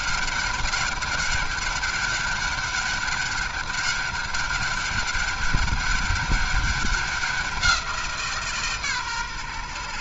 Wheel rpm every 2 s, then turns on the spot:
200, 200, 200, 200, 150.
none